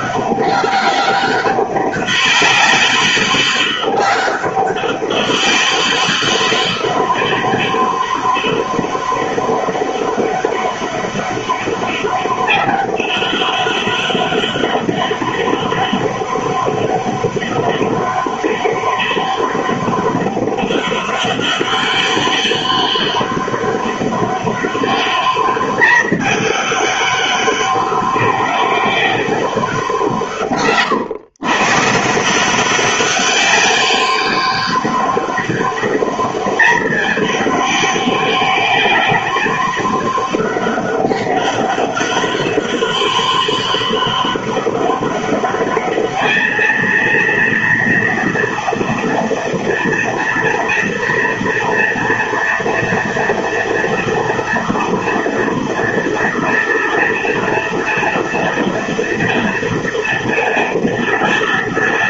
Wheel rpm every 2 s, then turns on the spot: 200, 200, 200, 200, 200, 200, 200, 200, 200, 200, 200, 190, 200, 200, 200, 130, 200, 200, 210, 200, 200, 200, 200, 230, 230, 230, 230, 230, 230, 230, 230.
none